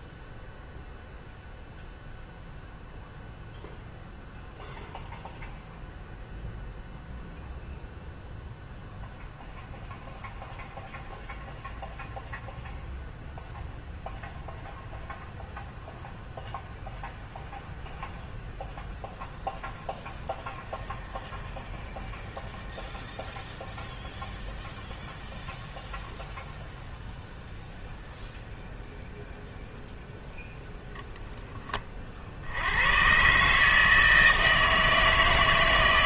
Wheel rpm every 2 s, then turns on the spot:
0, 0, 0, 0, 0, 0, 0, 0, 0, 0, 0, 0, 0, 0, 0, 0, 90, 160.
none